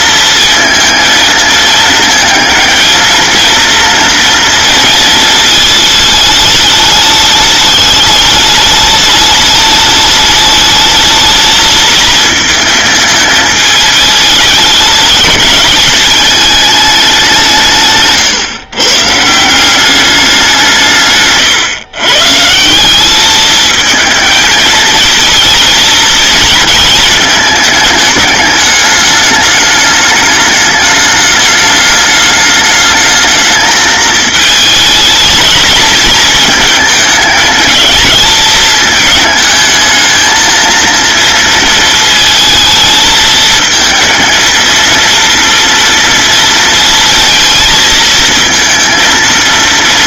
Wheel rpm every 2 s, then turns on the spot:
230, 230, 230, 210, 210, 210, 220, 210, 210, 130, 180, 170, 220, 230, 210, 210, 210, 220, 220, 220, 230, 220, 230, 230, 230.
none